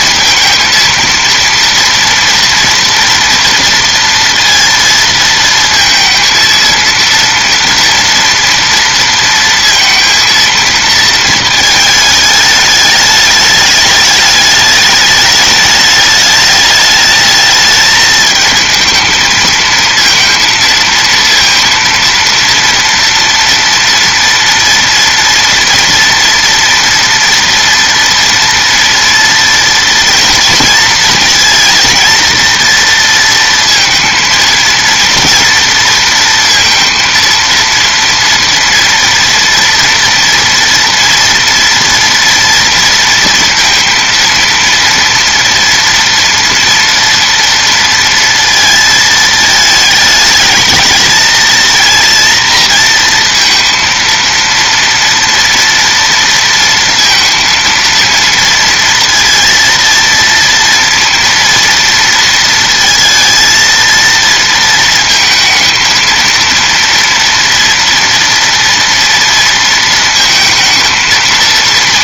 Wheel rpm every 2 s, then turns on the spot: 230, 230, 230, 230, 230, 230, 210, 210, 210, 220, 230, 230, 230, 240, 230, 230, 230, 230, 230, 230, 230, 230, 230, 230, 230, 220, 230, 230, 230, 230, 230, 230, 230, 230, 230, 230.
none